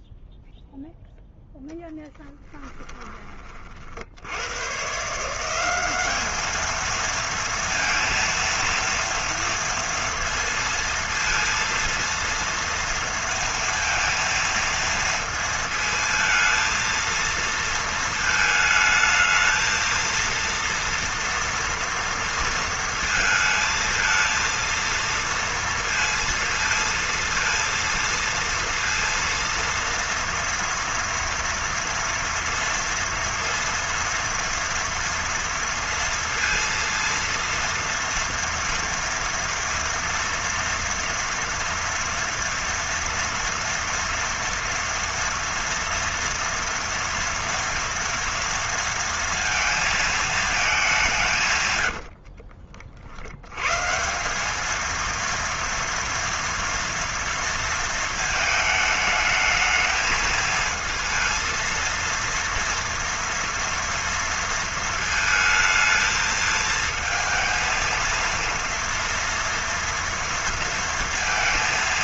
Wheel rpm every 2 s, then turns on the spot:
0, 30, 90, 210, 230, 230, 230, 230, 230, 220, 230, 230, 220, 230, 230, 230, 230, 230, 230, 230, 230, 230, 230, 230, 230, 220, 60, 180, 230, 220, 220, 230, 230, 220, 230, 230.
2-4 52-54